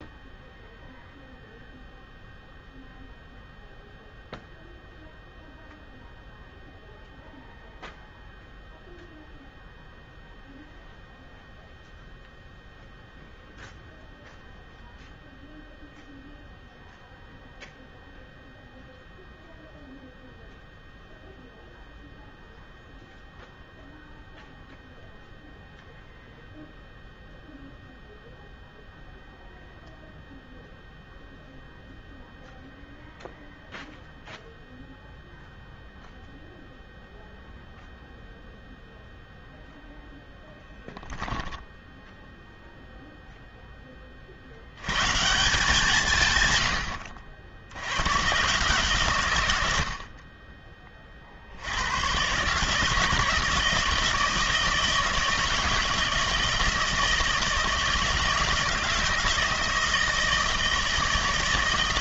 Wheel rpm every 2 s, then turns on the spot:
0, 0, 0, 0, 0, 0, 0, 0, 0, 0, 0, 0, 0, 0, 0, 0, 0, 0, 0, 0, 0, 0, 110, 90, 140, 30, 150, 160, 160, 160, 160.
none